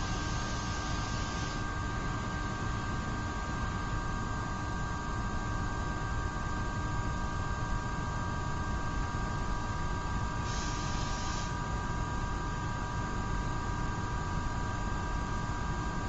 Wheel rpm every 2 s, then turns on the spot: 0, 0, 0, 0, 0, 0, 0, 0.
none